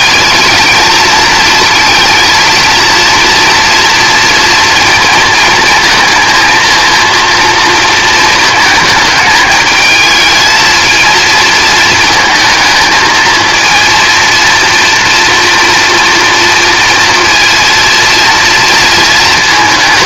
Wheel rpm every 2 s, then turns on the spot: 220, 230, 230, 230, 220, 220, 220, 230, 230, 230.
none